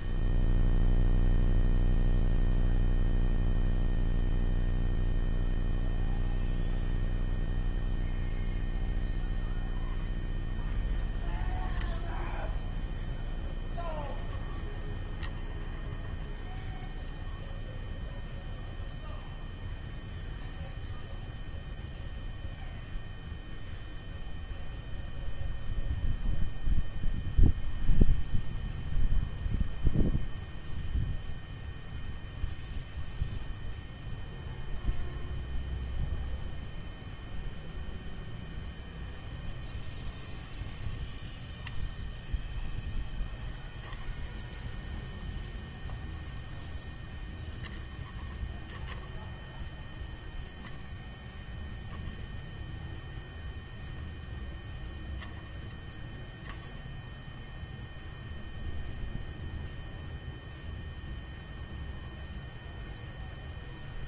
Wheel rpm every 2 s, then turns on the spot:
0, 0, 0, 0, 0, 0, 0, 0, 0, 0, 0, 0, 0, 0, 0, 0, 0, 0, 0, 0, 0, 10, 20, 0, 30, 0, 0, 0, 10, 0, 0, 0.
none